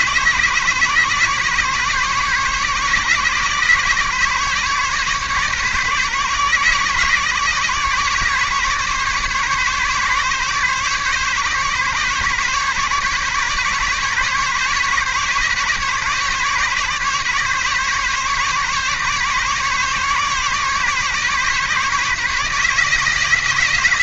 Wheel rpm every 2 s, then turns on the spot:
140, 140, 140, 140, 140, 140, 140, 140, 140, 140, 140, 150.
none